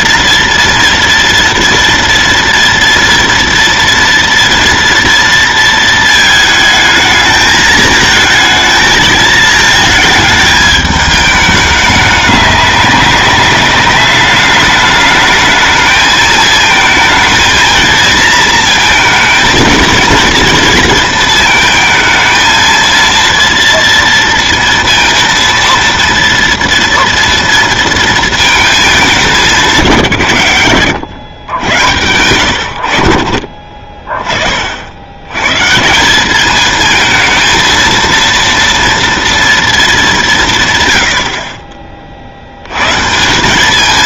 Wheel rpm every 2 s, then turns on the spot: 230, 230, 230, 220, 220, 210, 200, 210, 220, 230, 230, 230, 230, 230, 220, 110, 80, 60, 220, 230, 140, 110.
none